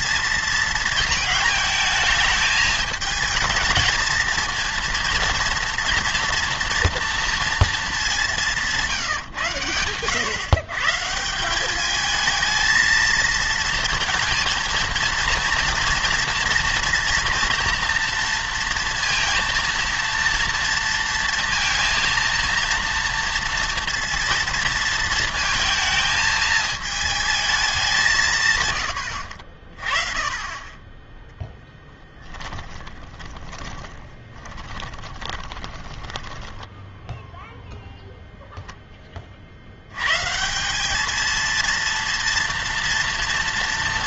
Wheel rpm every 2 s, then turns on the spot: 230, 220, 230, 230, 170, 130, 220, 230, 230, 230, 230, 230, 230, 220, 120, 20, 20, 20, 10, 0, 180, 230.
32-38